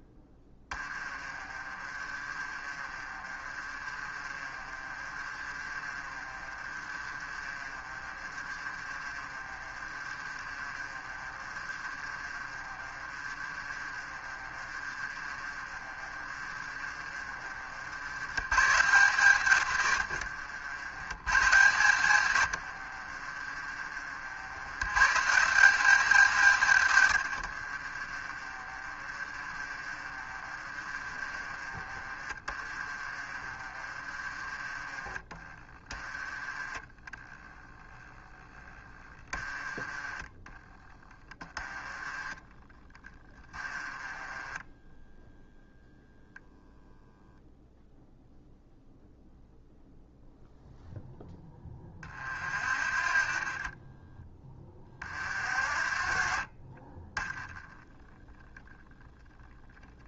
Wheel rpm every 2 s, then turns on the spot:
20, 30, 30, 30, 30, 30, 30, 30, 40, 130, 100, 60, 130, 110, 30, 30, 30, 30, 10, 20, 20, 30, 10, 0, 0, 0, 50, 40, 30, 10.
0-18 22-24 28-36 42-46 52-58